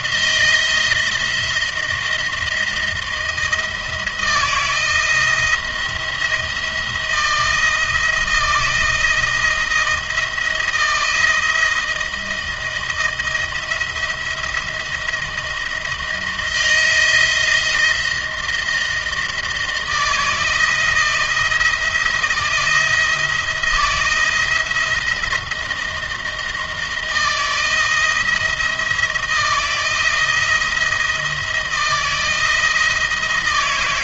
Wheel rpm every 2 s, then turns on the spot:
170, 170, 170, 170, 170, 170, 170, 170, 160, 170, 160, 170, 170, 170, 170, 170, 160.
none